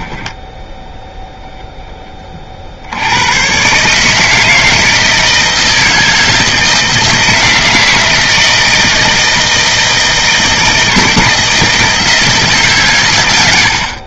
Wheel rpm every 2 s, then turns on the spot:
0, 50, 160, 160, 160, 160, 140.
none